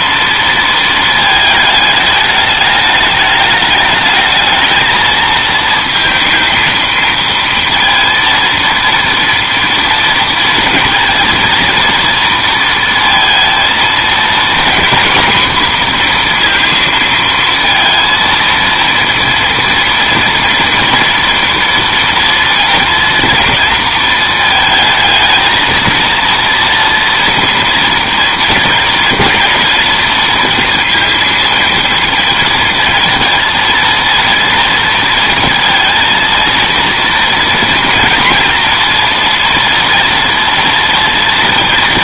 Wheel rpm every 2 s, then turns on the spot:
230, 210, 220, 220, 230, 230, 230, 250, 230, 230, 240, 230, 220, 240, 230, 230, 230, 230, 230, 230, 230.
none